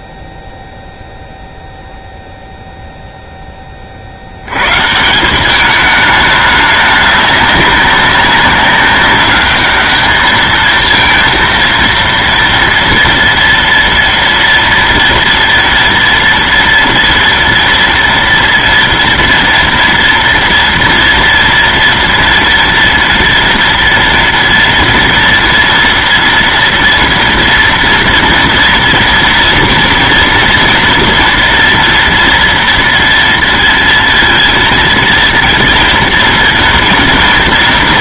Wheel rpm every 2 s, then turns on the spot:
0, 0, 120, 210, 200, 220, 230, 230, 230, 230, 230, 230, 230, 230, 230, 230, 230, 230, 230.
none